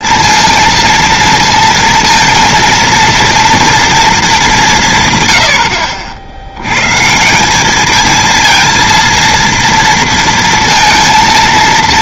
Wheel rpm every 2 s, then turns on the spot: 230, 230, 220, 80, 220, 230.
none